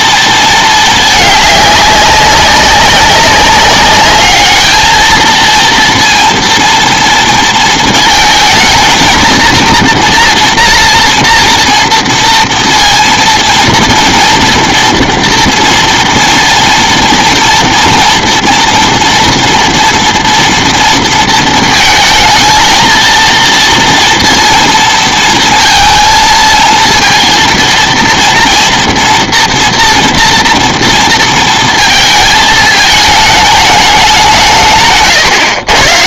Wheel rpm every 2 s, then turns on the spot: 220, 190, 210, 230, 230, 240, 240, 230, 230, 230, 230, 220, 230, 230, 230, 230, 220, 150.
none